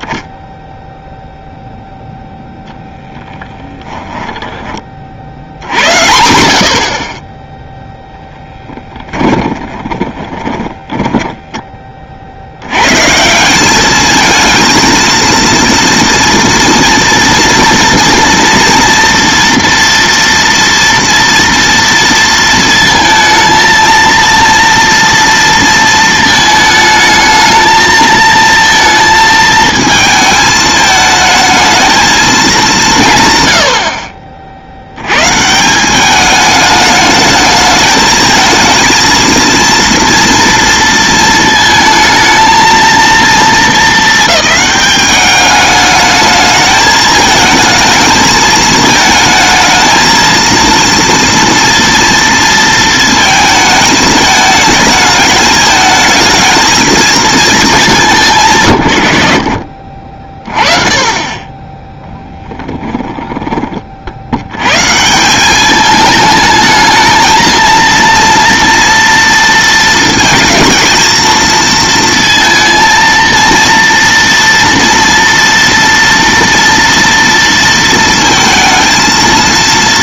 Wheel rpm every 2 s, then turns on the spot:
0, 10, 50, 40, 10, 10, 140, 230, 230, 230, 230, 220, 230, 220, 230, 220, 180, 90, 210, 220, 230, 230, 200, 220, 220, 230, 230, 220, 220, 110, 20, 20, 100, 220, 230, 220, 230, 240, 230, 220.
2-4 8-12 62-64